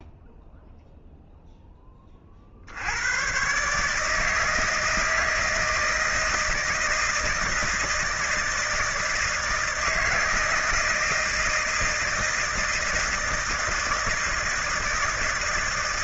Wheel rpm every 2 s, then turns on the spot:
0, 70, 160, 160, 160, 160, 160, 160.
none